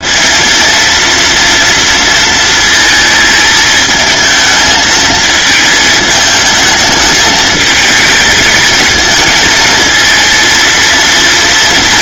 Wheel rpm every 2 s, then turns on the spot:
230, 220, 220, 220, 230, 230.
none